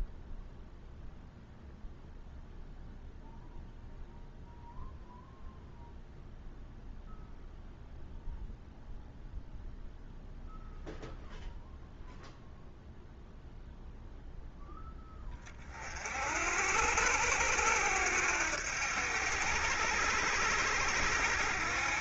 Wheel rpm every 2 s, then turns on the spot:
0, 0, 0, 0, 0, 0, 0, 10, 70, 80, 80.
none